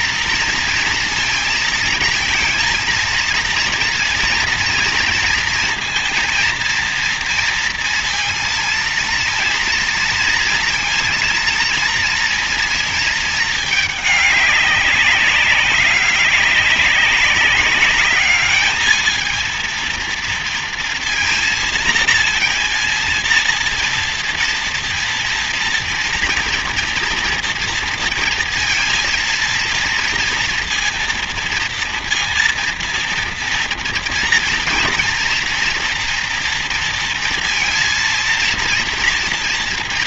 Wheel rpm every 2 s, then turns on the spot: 230, 230, 230, 230, 230, 230, 230, 200, 200, 210, 230, 230, 230, 230, 230, 230, 230, 230, 230, 230.
none